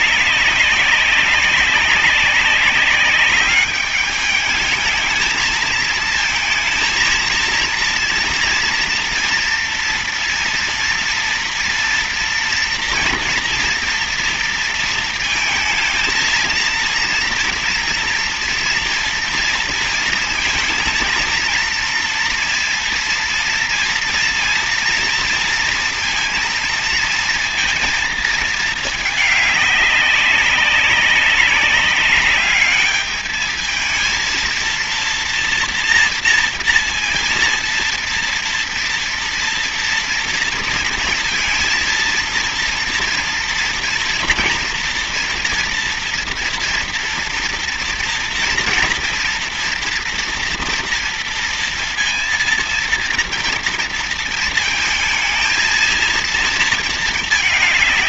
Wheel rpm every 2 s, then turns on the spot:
200, 200, 210, 220, 230, 240, 240, 230, 220, 230, 230, 230, 230, 230, 220, 190, 200, 230, 230, 230, 230, 230, 230, 230, 240, 230, 230, 230, 220.
none